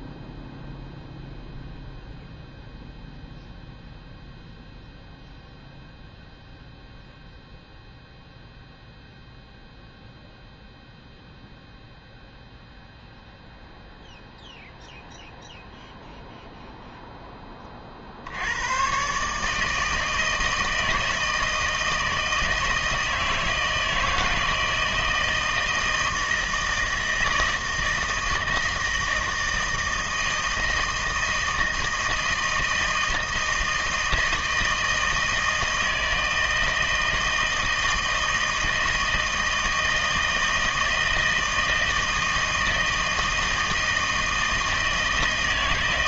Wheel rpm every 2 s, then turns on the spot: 0, 0, 0, 0, 0, 0, 0, 0, 0, 100, 160, 160, 160, 160, 160, 160, 160, 160, 160, 160, 160, 160, 160.
none